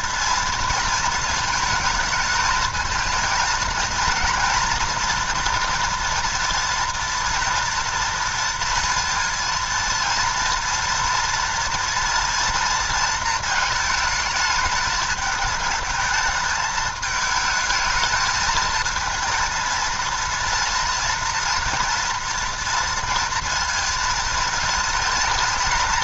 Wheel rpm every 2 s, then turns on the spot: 230, 220, 230, 230, 230, 230, 230, 220, 220, 220, 240, 230, 220.
none